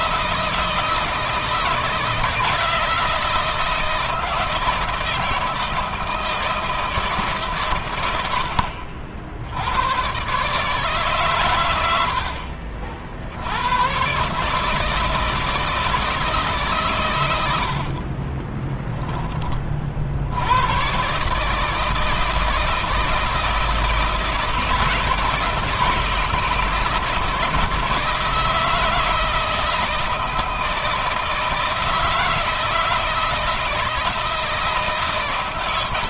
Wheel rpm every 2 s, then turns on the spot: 160, 160, 160, 160, 60, 140, 60, 160, 130, 20, 120, 160, 160, 160, 170, 170, 160, 160.
18-20